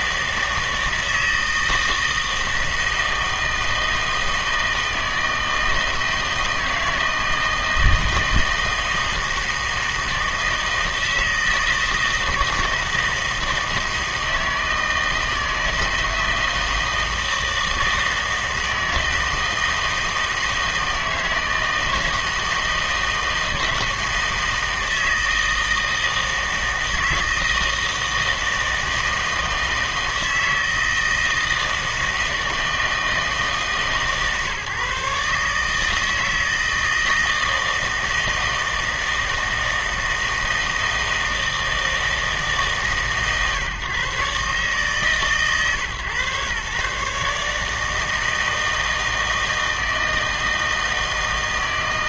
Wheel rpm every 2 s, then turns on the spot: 160, 160, 160, 160, 160, 160, 160, 160, 160, 160, 160, 160, 160, 160, 160, 160, 160, 140, 160, 160, 160, 150, 140, 130, 160, 160.
none